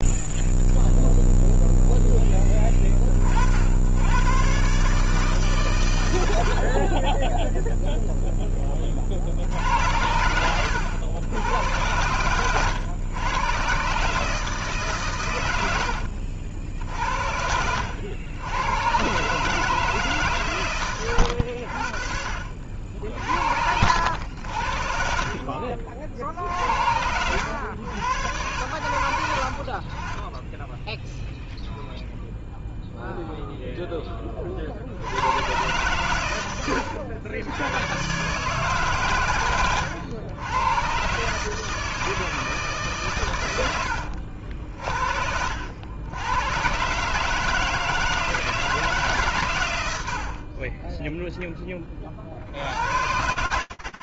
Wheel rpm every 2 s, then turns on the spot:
0, 10, 120, 70, 10, 90, 110, 160, 70, 100, 130, 60, 70, 80, 110, 20, 0, 40, 100, 140, 100, 160, 70, 110, 160, 50, 70.
10-12 30-32